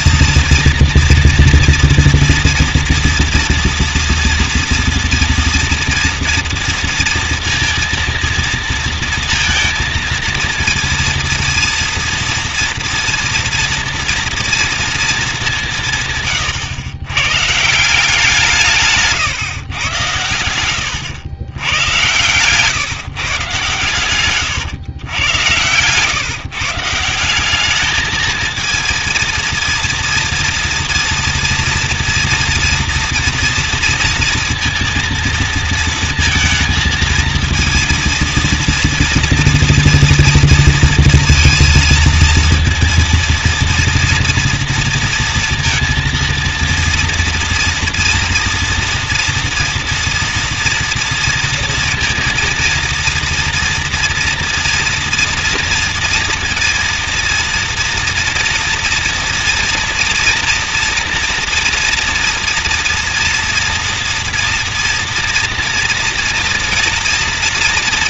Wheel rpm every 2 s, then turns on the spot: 230, 230, 230, 230, 230, 230, 230, 230, 110, 160, 90, 130, 110, 150, 230, 230, 230, 230, 230, 230, 230, 230, 230, 230, 230, 230, 230, 240, 230, 230, 230, 230, 230, 240.
20-22